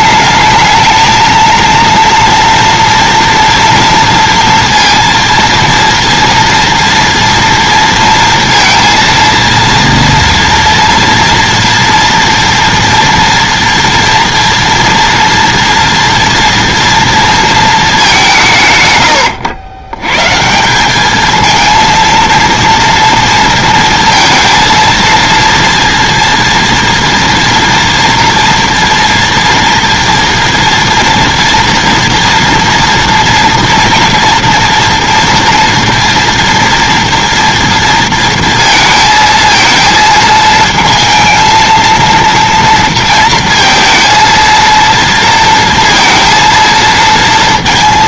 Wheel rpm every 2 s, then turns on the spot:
220, 230, 230, 230, 230, 230, 230, 230, 230, 150, 180, 230, 230, 230, 230, 240, 230, 230, 230, 230, 220, 230, 230, 230.
none